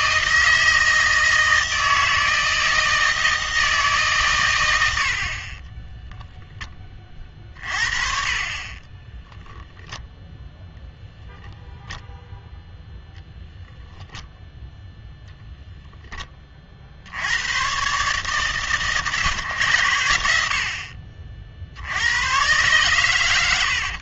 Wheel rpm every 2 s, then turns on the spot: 160, 160, 110, 10, 40, 0, 0, 0, 40, 140, 60, 120.
none